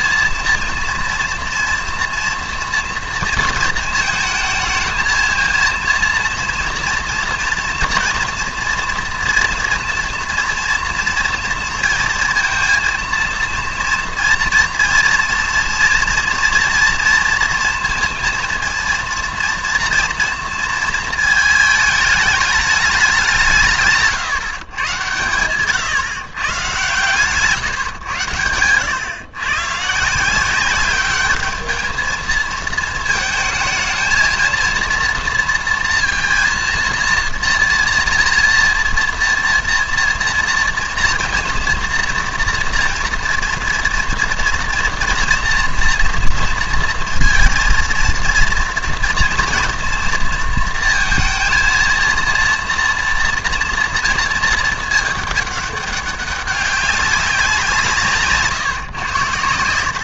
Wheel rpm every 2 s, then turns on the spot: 230, 230, 220, 230, 230, 230, 230, 230, 240, 230, 230, 210, 130, 140, 110, 190, 220, 230, 230, 230, 240, 230, 230, 230, 230, 230, 230, 220, 200, 140.
none